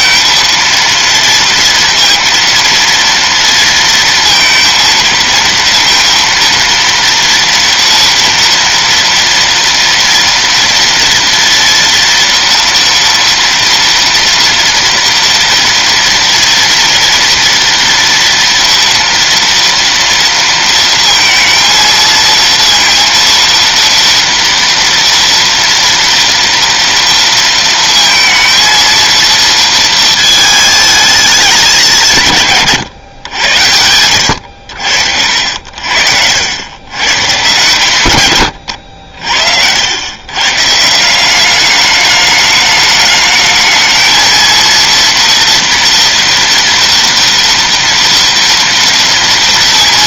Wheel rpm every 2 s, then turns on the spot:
230, 230, 230, 230, 230, 230, 230, 230, 230, 230, 230, 230, 230, 230, 230, 220, 130, 70, 90, 90, 140, 210, 230, 230, 230.
none